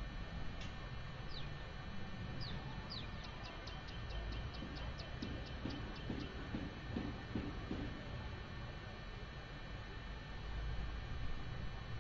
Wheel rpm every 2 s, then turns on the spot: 0, 0, 0, 0, 0, 0.
none